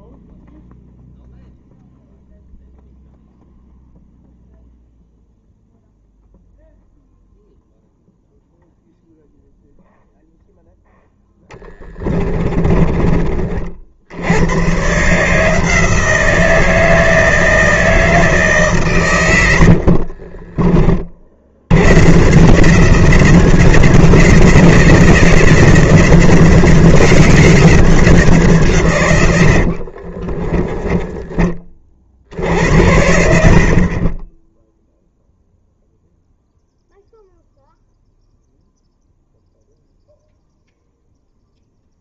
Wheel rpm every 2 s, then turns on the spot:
0, 0, 0, 0, 0, 0, 30, 130, 160, 140, 40, 170, 170, 180, 140, 10, 60, 0, 0, 0, 0.
12-14 30-32